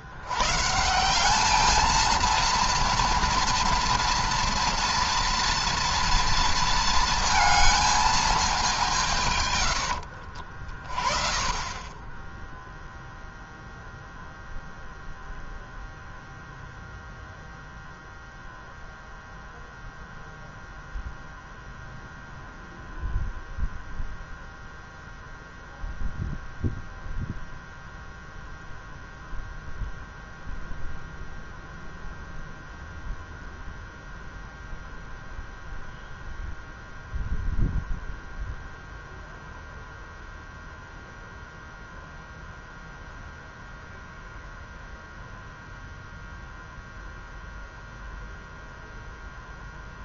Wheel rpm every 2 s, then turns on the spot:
150, 230, 230, 230, 190, 50, 0, 0, 0, 0, 0, 0, 0, 0, 0, 0, 0, 0, 0, 0, 0, 0, 0, 0, 0.
none